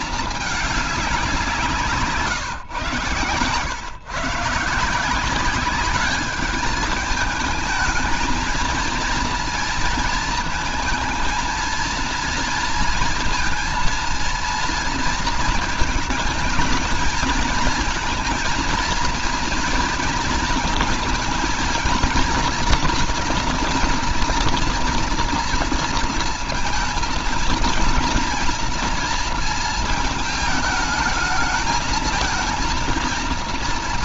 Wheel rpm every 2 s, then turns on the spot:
210, 130, 150, 210, 230, 220, 230, 230, 220, 230, 230, 230, 230, 230, 230, 220, 220.
none